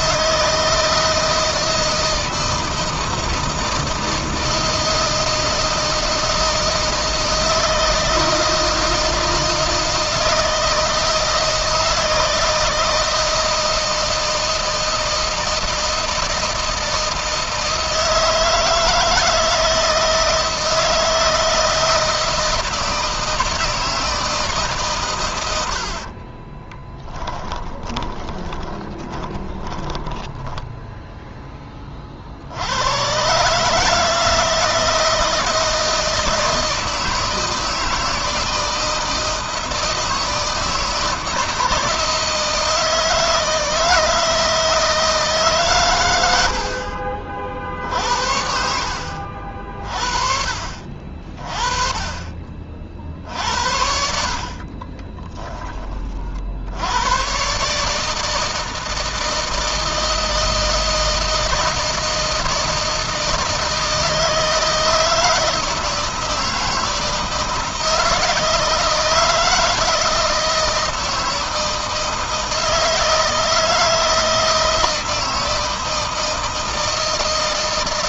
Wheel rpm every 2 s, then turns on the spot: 160, 160, 160, 160, 160, 160, 160, 160, 160, 160, 160, 160, 150, 30, 20, 0, 100, 160, 160, 160, 160, 160, 160, 60, 60, 60, 50, 40, 80, 160, 160, 160, 160, 160, 160, 160, 160, 160, 160.
26-30 54-56